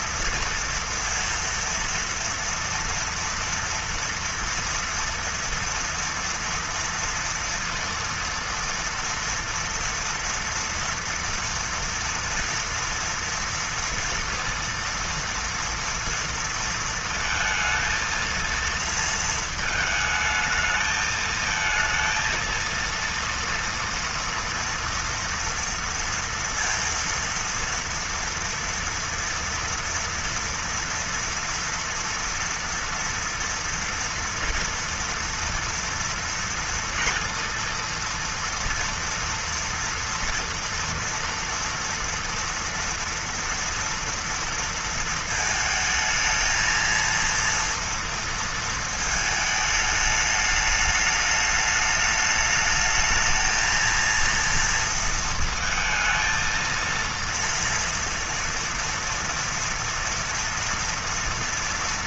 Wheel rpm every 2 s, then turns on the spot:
230, 230, 230, 230, 230, 230, 230, 230, 230, 230, 220, 230, 230, 230, 230, 230, 230, 240, 230, 230, 230, 240, 230, 220, 230, 210, 210, 230, 230, 230, 230.
none